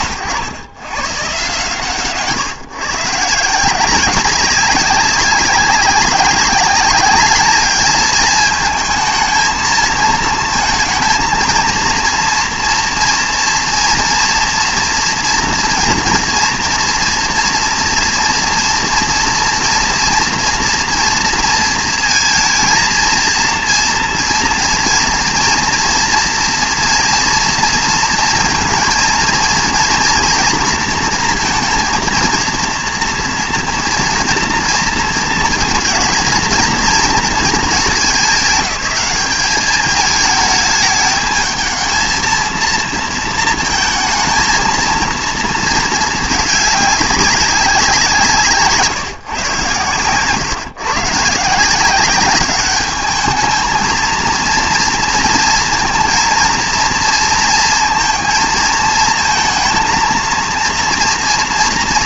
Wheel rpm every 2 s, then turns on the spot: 110, 150, 190, 200, 220, 230, 230, 230, 230, 240, 230, 230, 230, 240, 230, 230, 230, 230, 230, 190, 210, 230, 220, 210, 150, 130, 210, 230, 230, 220, 230.
48-50